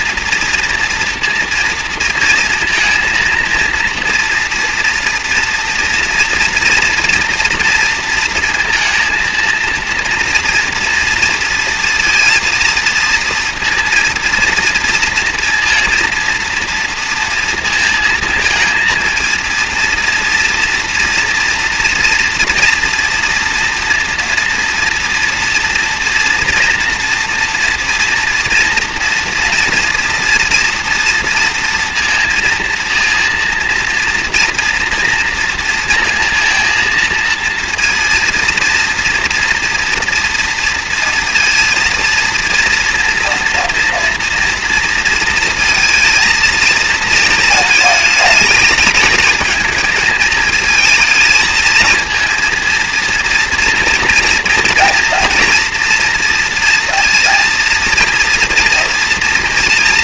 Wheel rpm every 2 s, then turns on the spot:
230, 230, 230, 230, 230, 230, 230, 230, 230, 220, 230, 230, 240, 230, 230, 230, 230, 230, 230, 230, 230, 240, 230, 230, 220, 220, 230, 230, 240, 240.
none